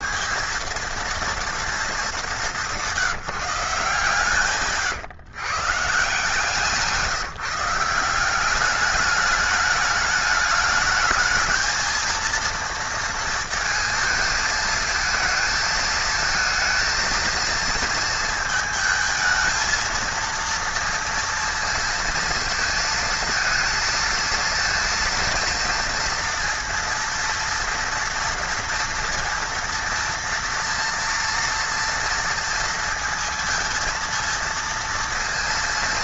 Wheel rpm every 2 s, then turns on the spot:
220, 190, 130, 160, 200, 210, 230, 220, 220, 220, 230, 230, 230, 230, 230, 230, 230, 230.
4-6